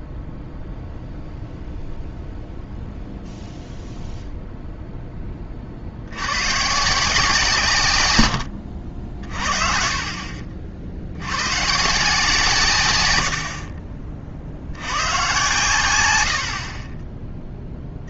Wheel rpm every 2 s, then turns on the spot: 0, 0, 0, 130, 70, 60, 150, 70, 50.
16-18